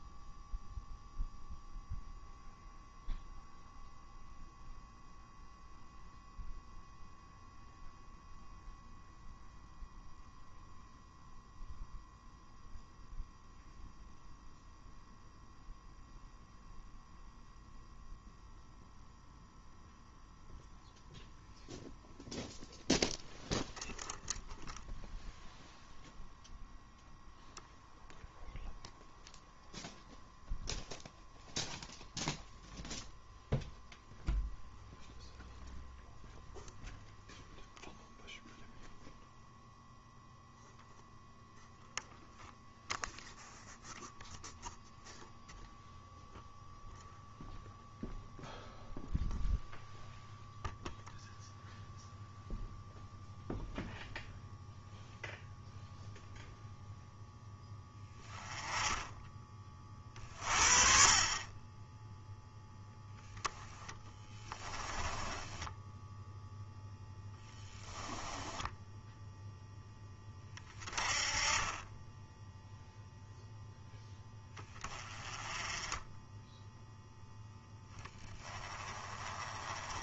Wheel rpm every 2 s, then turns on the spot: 0, 0, 0, 0, 0, 0, 0, 0, 0, 0, 0, 0, 0, 0, 0, 0, 0, 0, 0, 0, 0, 0, 0, 0, 0, 0, 0, 0, 0, 10, 40, 0, 20, 10, 10, 20, 0, 20, 0, 20.
64-66 68-70